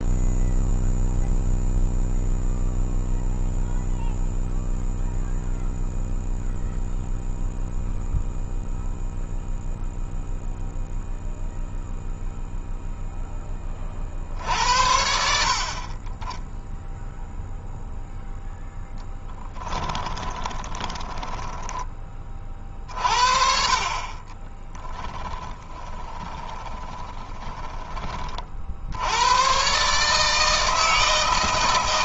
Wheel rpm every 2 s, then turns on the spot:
0, 0, 0, 0, 0, 0, 0, 60, 0, 0, 20, 40, 20, 20, 60, 160.
20-22 24-28